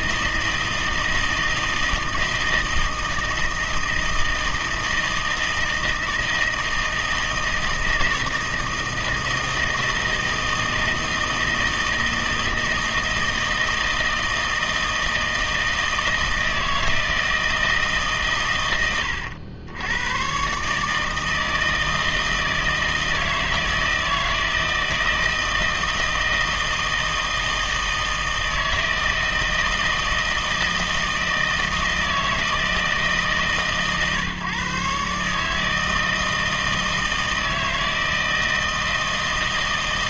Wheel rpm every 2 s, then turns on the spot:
160, 160, 160, 160, 160, 160, 160, 160, 160, 100, 150, 160, 160, 160, 160, 160, 160, 140, 160, 160.
none